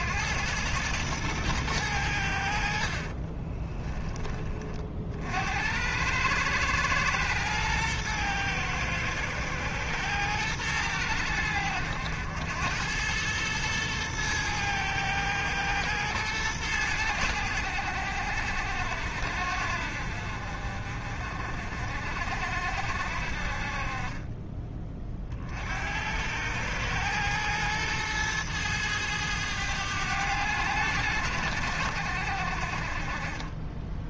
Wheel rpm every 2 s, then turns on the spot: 110, 60, 40, 110, 110, 100, 100, 110, 110, 70, 50, 60, 20, 100, 110, 90, 50.
none